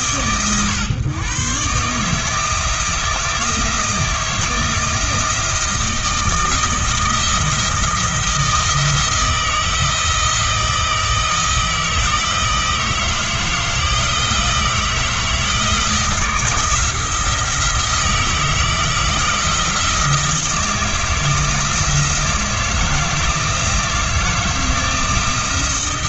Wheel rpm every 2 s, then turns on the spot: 120, 160, 160, 170, 160, 160, 160, 160, 170, 160, 160, 170, 160.
none